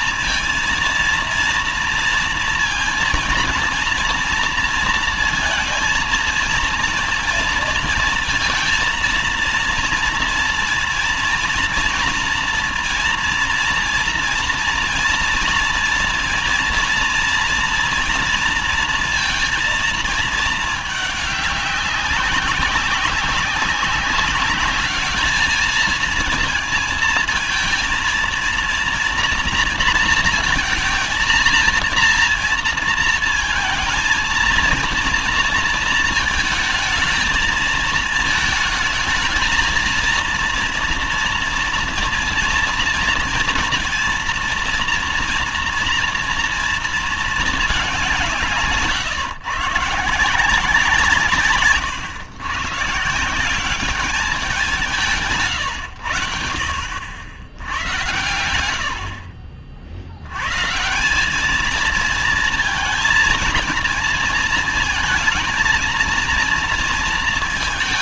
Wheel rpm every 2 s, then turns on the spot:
230, 230, 230, 230, 230, 230, 230, 230, 230, 230, 210, 190, 200, 230, 230, 220, 230, 230, 220, 220, 230, 230, 230, 230, 150, 170, 130, 190, 80, 90, 130, 230, 230, 230.
none